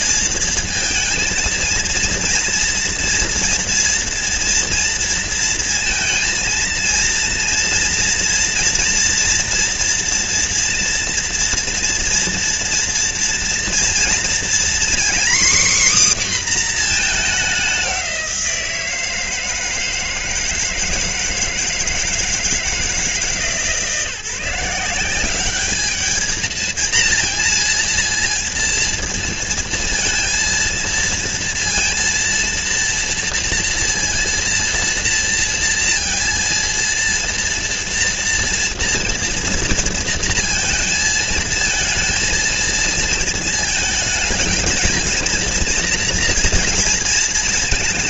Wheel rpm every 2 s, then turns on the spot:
230, 230, 230, 230, 230, 230, 230, 250, 230, 170, 160, 160, 180, 230, 230, 230, 230, 230, 230, 230, 230, 230, 220, 230.
none